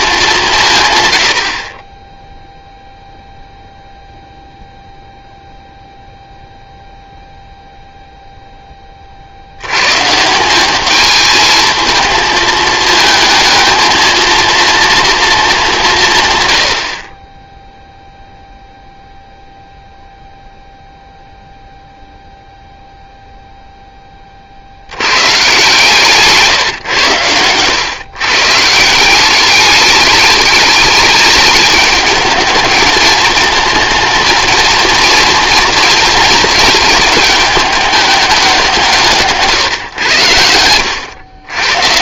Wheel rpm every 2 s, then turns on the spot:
160, 0, 0, 0, 10, 190, 220, 230, 100, 0, 0, 0, 70, 140, 160, 210, 210, 220, 220, 180, 90.
none